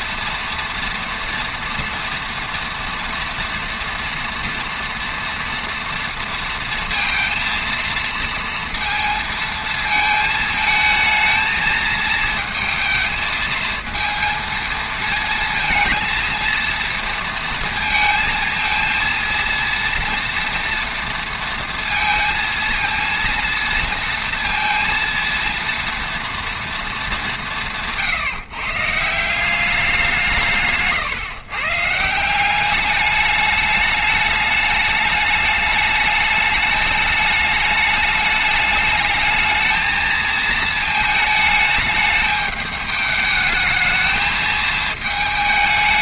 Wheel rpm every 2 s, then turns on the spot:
230, 230, 230, 230, 230, 220, 220, 230, 230, 230, 230, 230, 230, 230, 150, 160, 180, 210, 210, 210, 220, 210, 220.
none